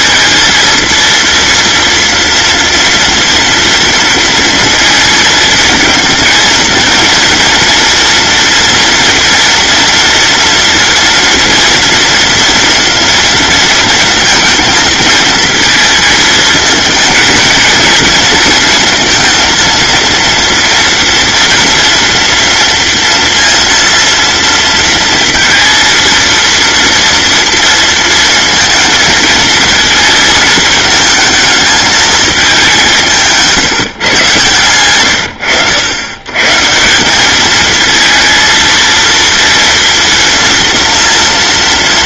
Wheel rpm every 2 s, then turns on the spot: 230, 230, 230, 230, 230, 230, 230, 230, 220, 230, 230, 230, 230, 230, 220, 220, 180, 110, 150, 230, 230.
none